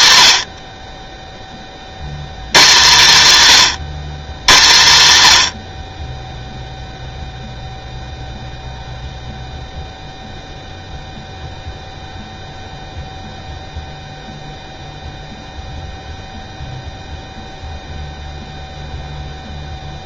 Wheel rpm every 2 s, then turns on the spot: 30, 150, 70, 0, 0, 0, 0, 0, 0, 0.
none